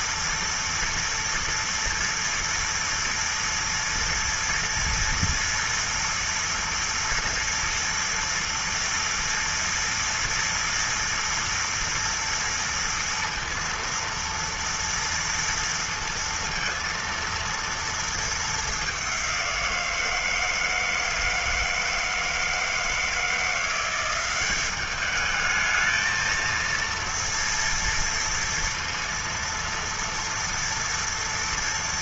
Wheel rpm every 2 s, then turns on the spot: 240, 230, 230, 230, 230, 230, 230, 230, 230, 220, 170, 160, 180, 220, 230, 230.
none